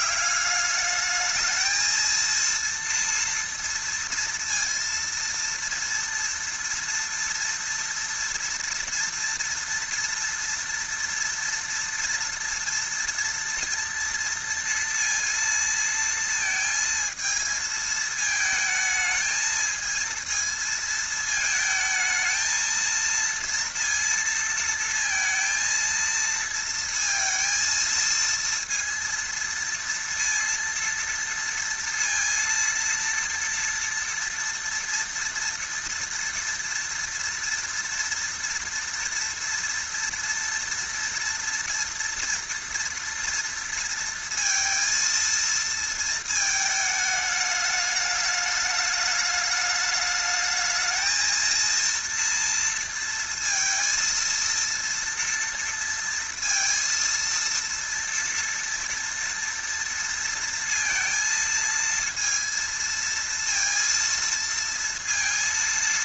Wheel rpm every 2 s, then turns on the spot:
210, 230, 230, 230, 230, 230, 230, 230, 220, 220, 220, 230, 230, 230, 230, 230, 230, 230, 230, 230, 230, 230, 230, 210, 210, 220, 230, 230, 230, 230, 230, 230, 230.
none